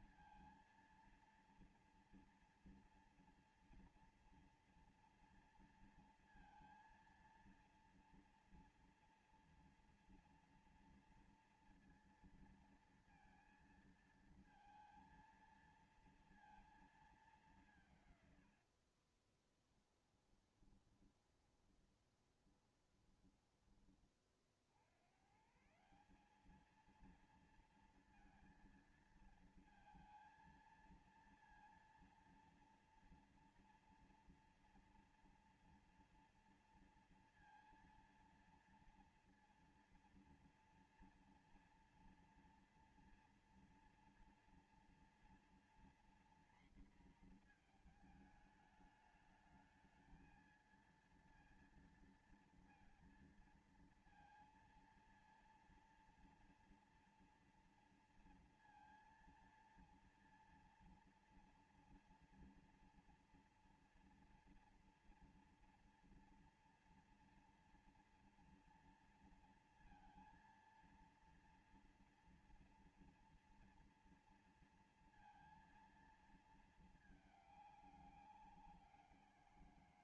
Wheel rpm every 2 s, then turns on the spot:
230, 230, 230, 230, 230, 230, 230, 230, 220, 100, 20, 20, 40, 200, 230, 230, 230, 230, 230, 230, 230, 230, 230, 240, 220, 220, 230, 230, 230, 230, 230, 230, 230, 230, 230, 230, 230, 230, 230, 190.
18-24